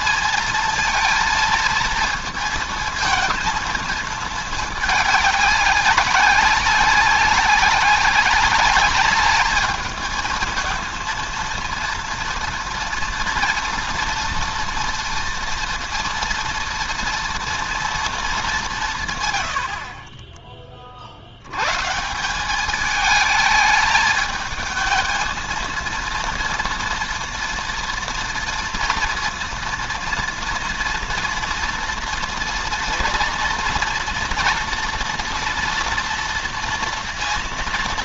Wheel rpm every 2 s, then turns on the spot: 230, 230, 220, 190, 200, 220, 230, 230, 230, 200, 30, 190, 220, 230, 230, 230, 230, 230, 230.
none